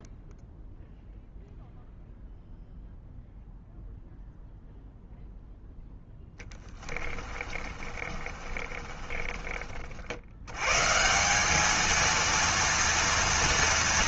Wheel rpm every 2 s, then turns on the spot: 0, 0, 0, 20, 30, 140, 230.
6-10